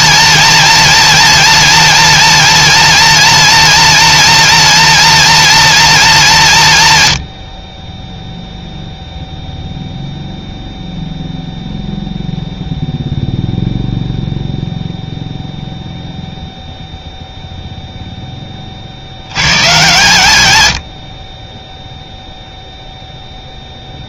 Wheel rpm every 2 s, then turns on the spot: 230, 230, 230, 150, 0, 0, 0, 0, 0, 30, 90, 0.
none